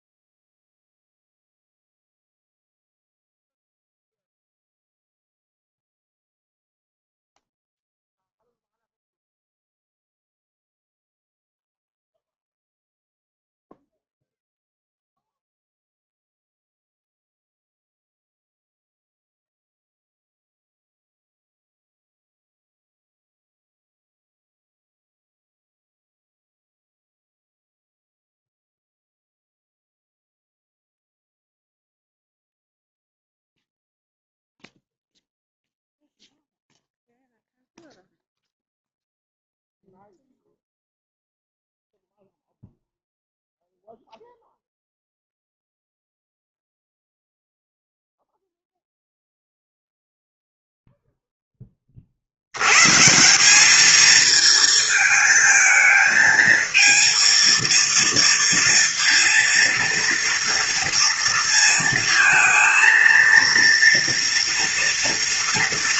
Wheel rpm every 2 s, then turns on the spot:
0, 0, 0, 0, 0, 0, 0, 0, 0, 0, 0, 0, 0, 0, 0, 0, 0, 0, 0, 0, 0, 0, 0, 0, 0, 0, 100, 220, 220, 230, 230, 230, 230.
none